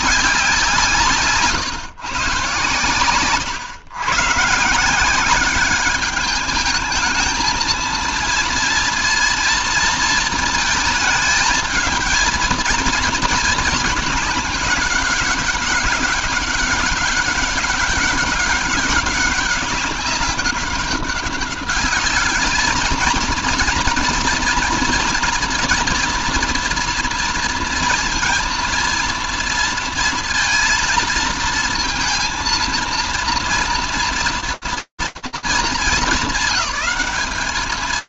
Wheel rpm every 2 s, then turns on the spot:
200, 140, 130, 200, 230, 220, 230, 210, 190, 200, 200, 210, 230, 230, 230, 230, 230, 220, 200.
none